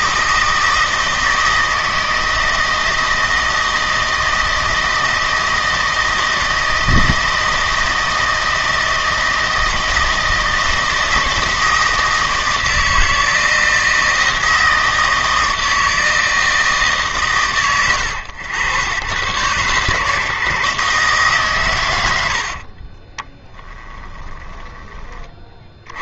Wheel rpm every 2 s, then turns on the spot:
160, 160, 160, 160, 160, 160, 160, 160, 150, 100, 150, 40, 20.
22-26